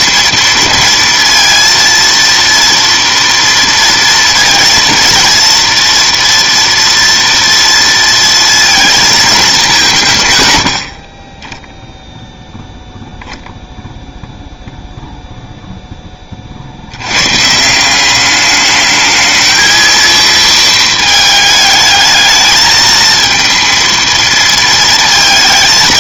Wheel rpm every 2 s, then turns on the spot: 230, 230, 230, 230, 230, 100, 0, 0, 50, 210, 220, 220, 230.
none